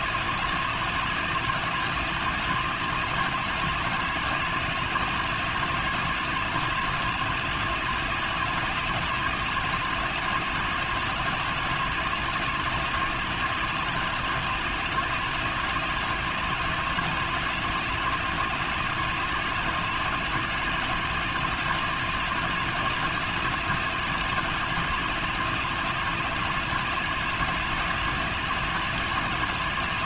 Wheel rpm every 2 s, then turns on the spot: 160, 170, 160, 160, 160, 160, 160, 160, 160, 160, 160, 160, 160, 160, 160.
none